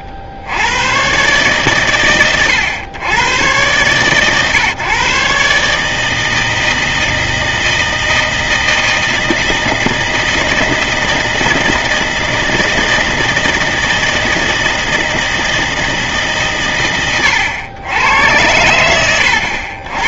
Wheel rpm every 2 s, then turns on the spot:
80, 110, 130, 160, 160, 160, 160, 160, 130, 80.
none